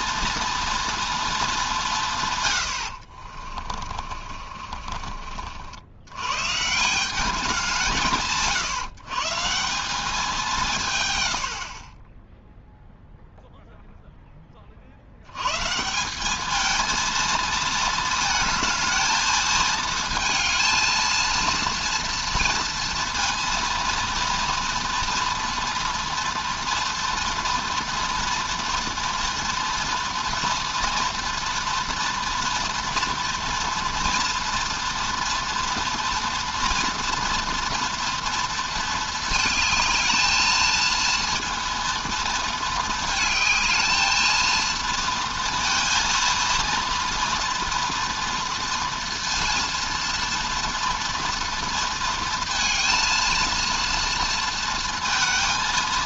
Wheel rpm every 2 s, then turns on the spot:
230, 90, 40, 160, 150, 160, 0, 40, 220, 220, 230, 230, 240, 230, 240, 240, 230, 230, 230, 230, 220, 220, 230, 230, 230, 230, 230, 230.
2-6